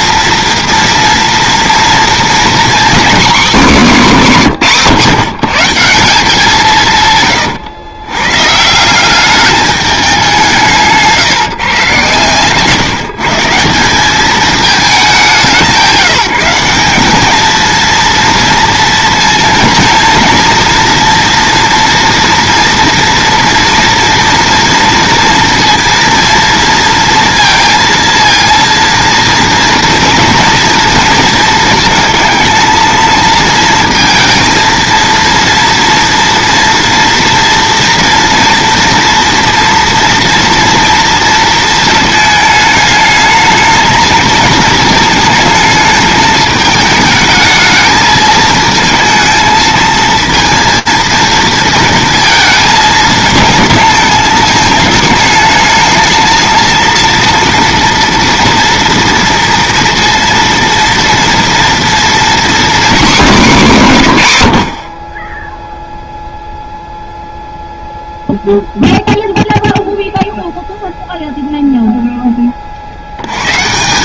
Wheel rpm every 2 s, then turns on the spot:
230, 240, 220, 180, 160, 170, 130, 210, 180, 230, 240, 230, 240, 230, 230, 230, 230, 230, 230, 230, 230, 220, 220, 220, 220, 230, 220, 220, 230, 230, 230, 250, 70, 0, 0, 0, 40.
none